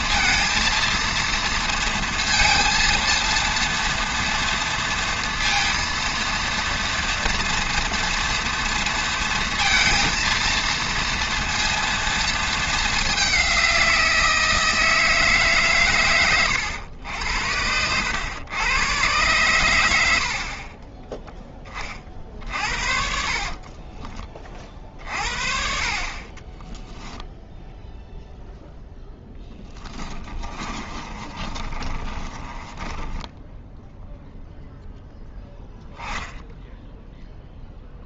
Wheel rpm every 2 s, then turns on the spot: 230, 230, 230, 230, 230, 230, 220, 160, 90, 110, 30, 60, 40, 10, 0, 30, 20, 0, 0.
20-24 30-34